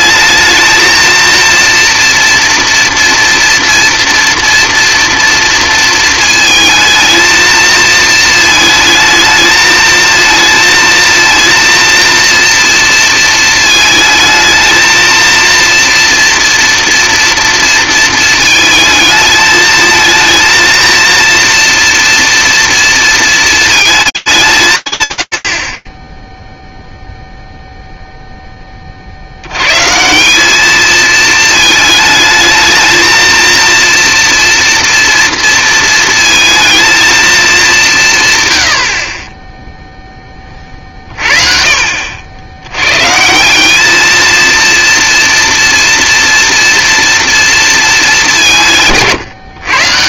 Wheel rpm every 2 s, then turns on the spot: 230, 230, 230, 230, 220, 230, 230, 230, 230, 220, 230, 230, 120, 0, 40, 220, 230, 230, 230, 50, 50, 160, 230, 230, 160.
none